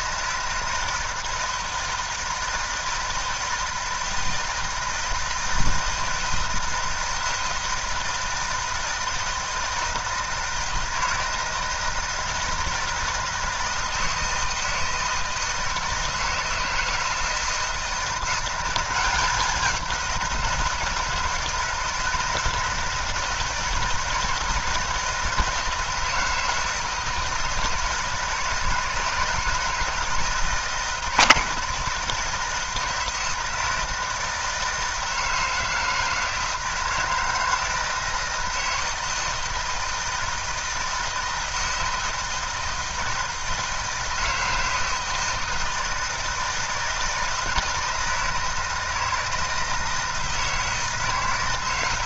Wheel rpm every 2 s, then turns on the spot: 160, 160, 160, 160, 160, 160, 160, 170, 160, 180, 160, 160, 160, 160, 160, 160, 160, 160, 160, 160, 160, 160, 160, 160, 160, 160.
none